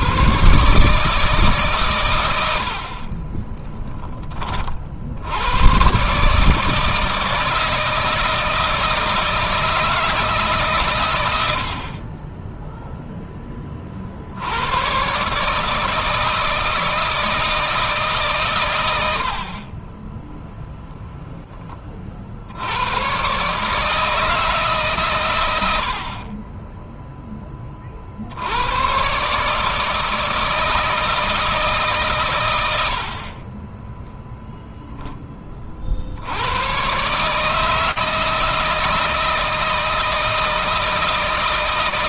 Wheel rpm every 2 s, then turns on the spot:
150, 50, 50, 160, 160, 120, 0, 120, 160, 100, 0, 100, 140, 10, 110, 160, 80, 0, 130, 160, 160.
2-4